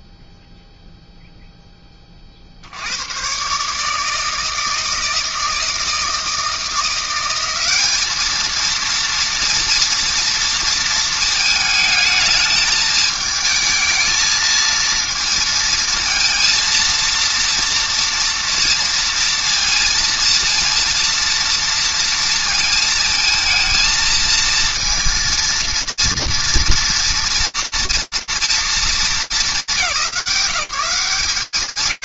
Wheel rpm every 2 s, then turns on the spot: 0, 10, 140, 160, 200, 230, 220, 220, 230, 230, 230, 230, 220, 230, 230, 160.
none